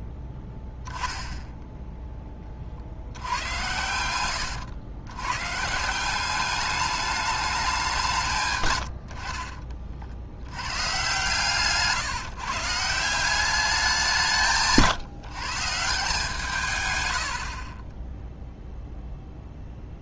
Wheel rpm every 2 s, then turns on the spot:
10, 50, 110, 210, 100, 120, 160, 150, 120, 0.
8-10